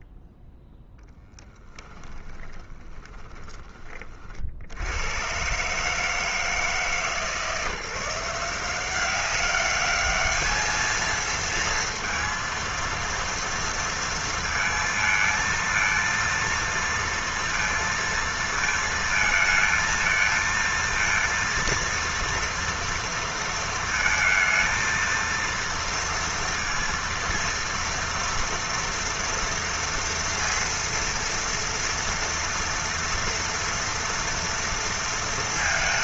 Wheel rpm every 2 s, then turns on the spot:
0, 10, 60, 150, 180, 220, 230, 230, 230, 230, 230, 230, 230, 230, 230, 230, 230, 230.
2-4